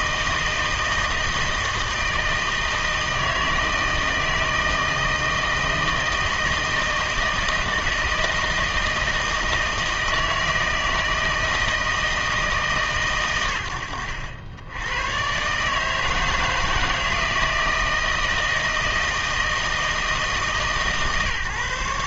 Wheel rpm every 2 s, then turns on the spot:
160, 160, 160, 160, 160, 160, 150, 90, 160, 160, 150.
none